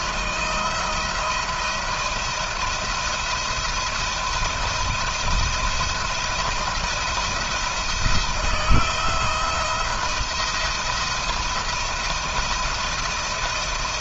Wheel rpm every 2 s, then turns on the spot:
170, 170, 170, 160, 170, 170, 170.
none